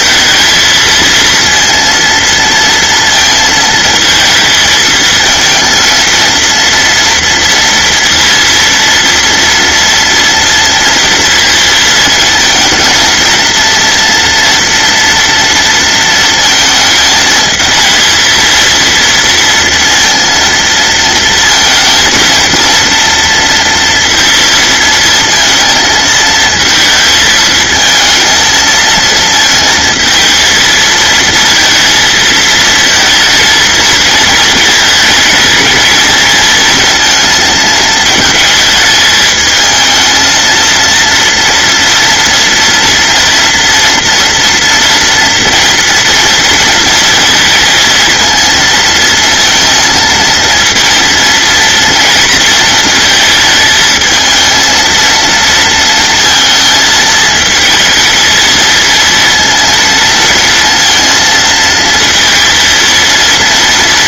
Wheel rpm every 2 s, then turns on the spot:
220, 230, 230, 230, 230, 230, 230, 220, 230, 220, 230, 230, 230, 230, 220, 230, 230, 220, 220, 230, 220, 230, 230, 240, 230, 230, 230, 220, 230, 220, 230, 230.
none